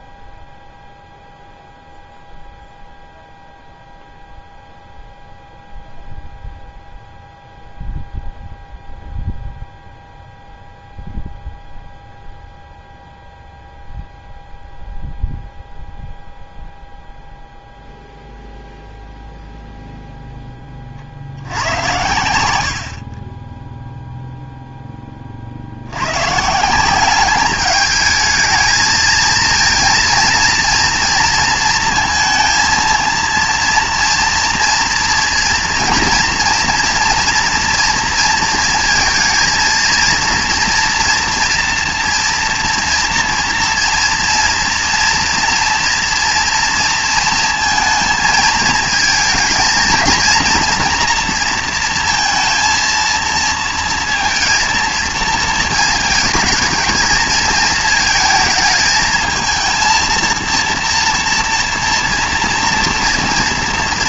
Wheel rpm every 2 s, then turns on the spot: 0, 0, 0, 0, 0, 0, 0, 0, 0, 0, 10, 80, 0, 150, 220, 230, 230, 230, 230, 230, 240, 230, 230, 230, 220, 230, 230, 230, 230, 220, 230, 230.
none